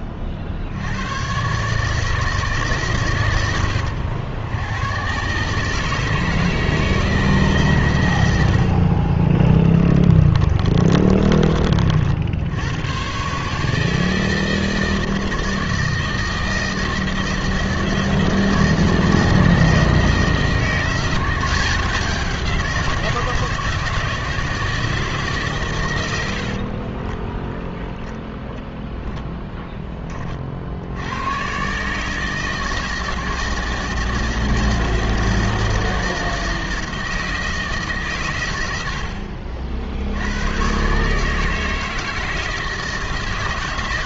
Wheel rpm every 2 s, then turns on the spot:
70, 110, 100, 160, 80, 30, 100, 160, 160, 160, 170, 180, 160, 50, 0, 60, 160, 160, 160, 100, 120, 160.
8-12 26-28